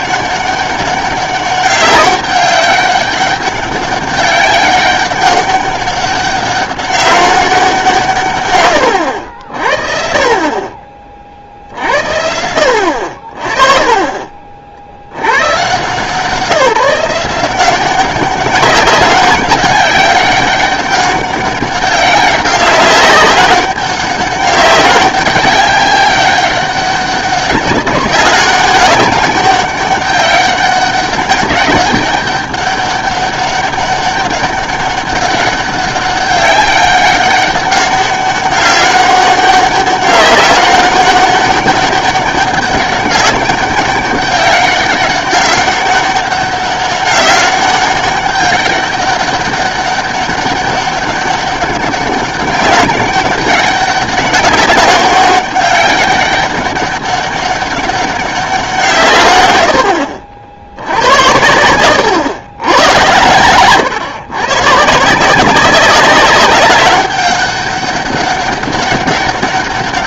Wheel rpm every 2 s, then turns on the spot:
200, 200, 200, 200, 110, 40, 80, 50, 170, 190, 190, 190, 200, 200, 200, 200, 200, 200, 200, 200, 200, 200, 200, 200, 200, 200, 190, 190, 200, 190, 70, 100, 150, 200, 200.
none